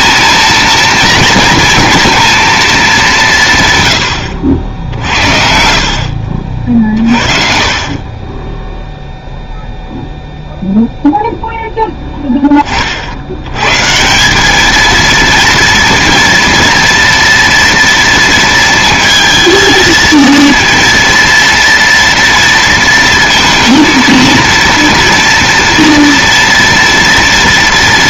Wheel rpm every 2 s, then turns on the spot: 230, 200, 70, 40, 0, 0, 40, 220, 230, 220, 230, 230, 230, 230.
6-8